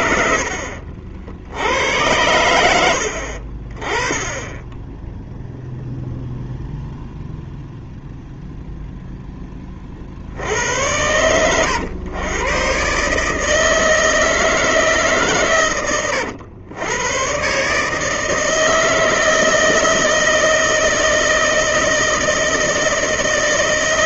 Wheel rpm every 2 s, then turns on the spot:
60, 80, 10, 0, 0, 90, 140, 150, 110, 160, 160, 160.
none